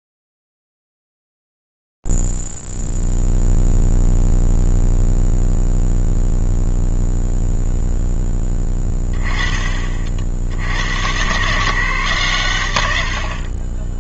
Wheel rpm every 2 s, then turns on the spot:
0, 0, 0, 0, 0, 30, 150.
none